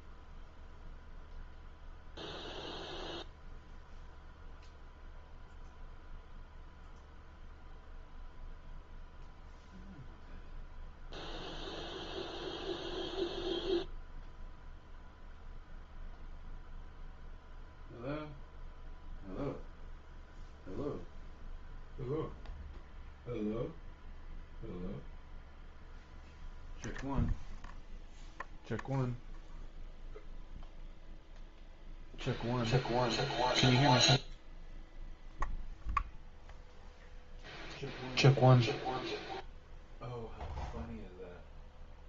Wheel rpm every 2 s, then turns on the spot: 0, 0, 0, 0, 0, 0, 0, 0, 0, 0, 0, 0, 0, 0, 0, 0, 0, 0, 0, 0, 0.
none